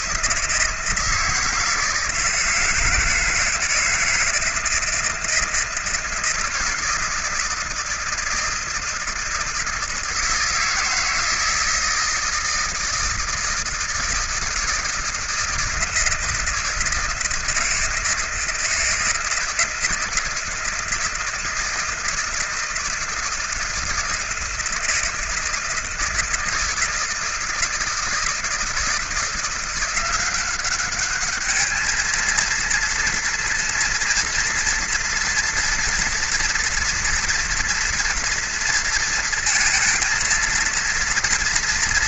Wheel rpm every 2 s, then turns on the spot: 160, 160, 160, 160, 160, 160, 160, 160, 160, 160, 160, 160, 160, 160, 170, 200, 230, 230, 230, 230, 230.
none